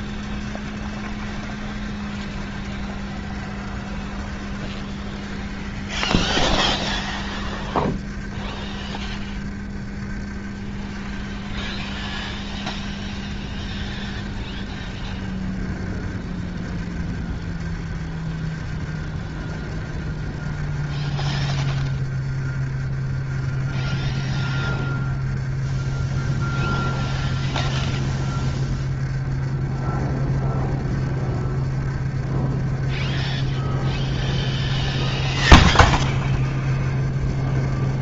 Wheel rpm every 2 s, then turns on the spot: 30, 30, 30, 30, 30, 30, 30, 30, 30, 30, 30, 30, 30, 30, 30, 30, 30, 30, 30.
36-38